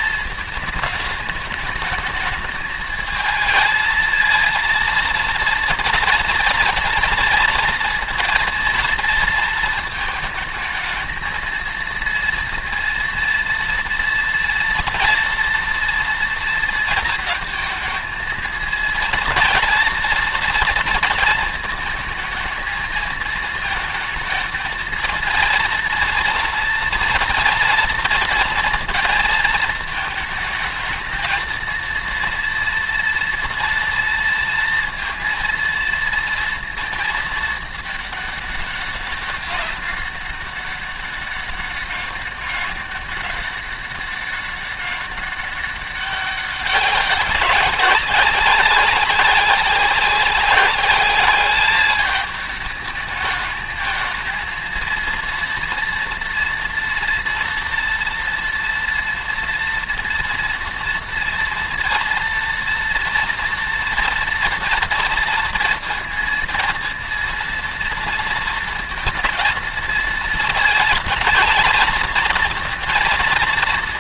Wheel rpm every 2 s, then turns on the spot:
220, 220, 230, 230, 230, 220, 230, 230, 230, 220, 230, 220, 220, 230, 230, 220, 230, 230, 230, 200, 200, 200, 200, 200, 190, 190, 210, 230, 230, 230, 240, 230, 230, 230, 230, 230, 230.
none